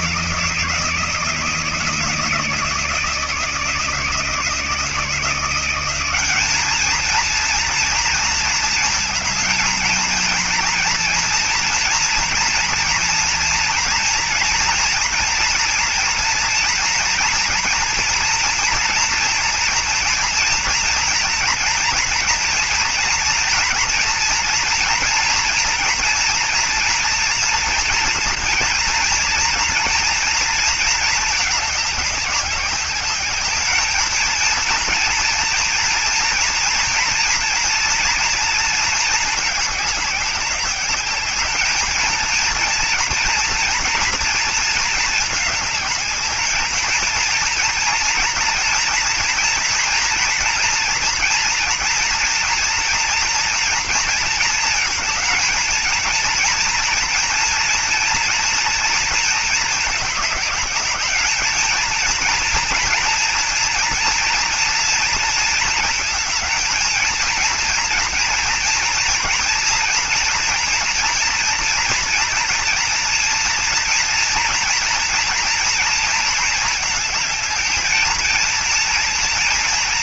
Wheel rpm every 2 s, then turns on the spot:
160, 160, 160, 200, 230, 230, 230, 230, 230, 230, 230, 230, 230, 230, 230, 230, 200, 220, 230, 230, 200, 220, 230, 220, 230, 230, 230, 230, 230, 230, 210, 230, 230, 220, 230, 230, 240, 240, 220, 220.
none